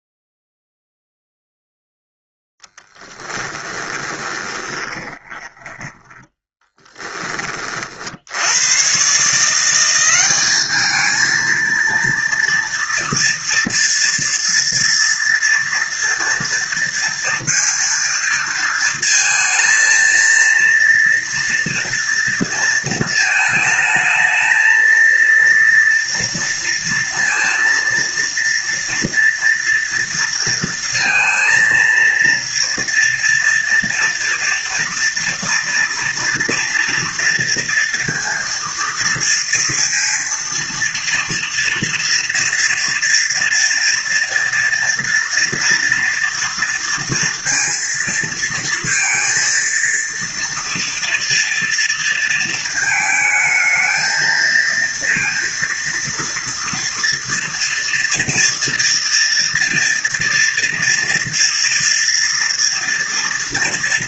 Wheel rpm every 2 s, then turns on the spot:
0, 0, 20, 20, 70, 200, 230, 230, 230, 230, 230, 230, 220, 230, 230, 230, 230, 230, 230, 230, 240, 230, 230, 230, 230, 230, 230, 220, 230, 230, 230, 230.
4-8